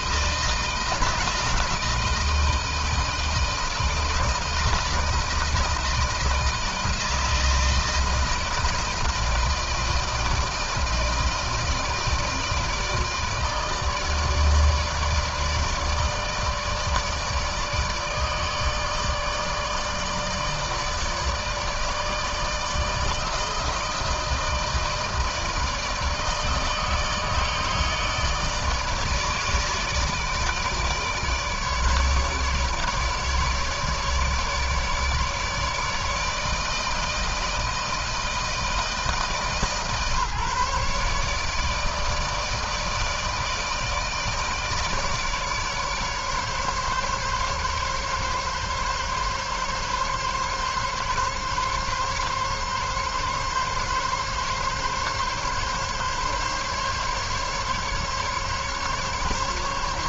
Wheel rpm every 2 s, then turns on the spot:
160, 160, 160, 160, 160, 160, 160, 150, 160, 150, 150, 160, 160, 150, 160, 150, 150, 150, 160, 160, 140, 160, 150, 140, 140, 140, 140, 140, 140, 150.
none